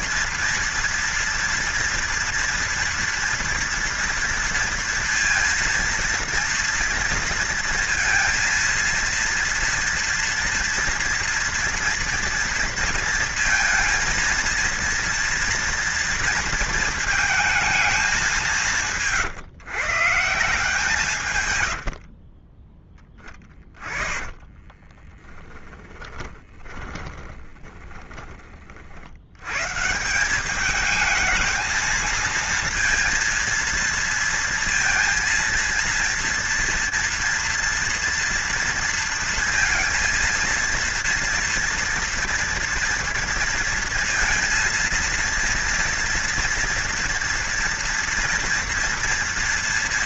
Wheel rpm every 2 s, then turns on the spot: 230, 230, 230, 230, 230, 230, 230, 230, 220, 150, 160, 10, 20, 20, 80, 220, 230, 230, 230, 230, 230, 230, 230, 230, 230.
22-28